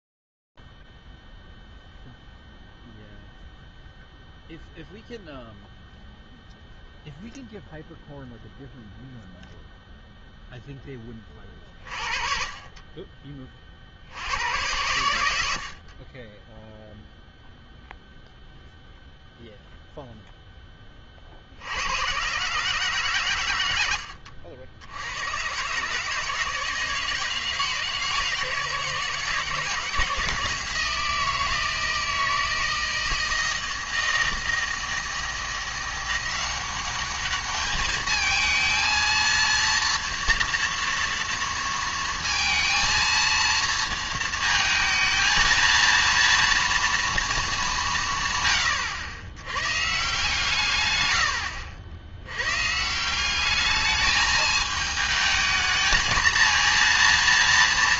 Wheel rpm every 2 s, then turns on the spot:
0, 0, 0, 0, 0, 0, 40, 70, 30, 0, 10, 130, 70, 160, 160, 160, 160, 160, 180, 220, 230, 230, 220, 230, 110, 140, 130, 220, 230.
none